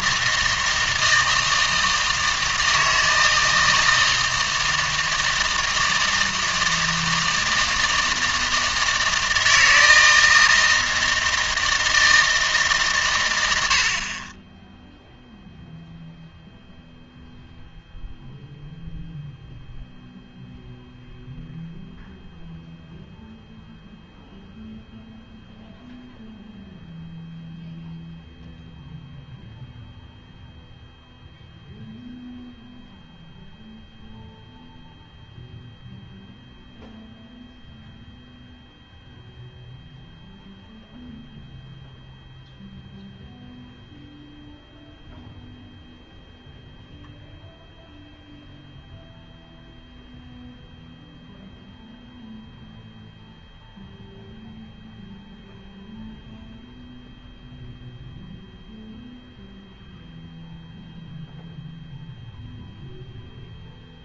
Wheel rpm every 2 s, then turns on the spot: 160, 160, 160, 160, 160, 160, 150, 10, 0, 0, 0, 0, 0, 0, 0, 0, 0, 0, 0, 0, 0, 0, 0, 0, 0, 0, 0, 0, 0, 0, 0, 0.
none